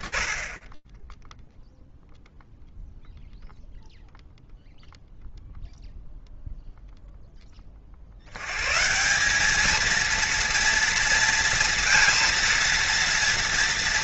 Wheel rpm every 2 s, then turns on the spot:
10, 0, 0, 0, 160, 230, 230.
none